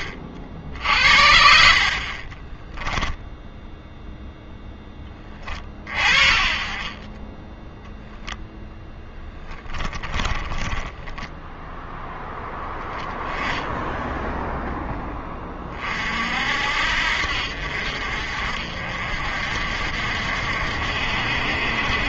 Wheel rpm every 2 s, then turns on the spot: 60, 10, 10, 20, 10, 10, 0, 10, 60, 50, 60.
2-4 10-12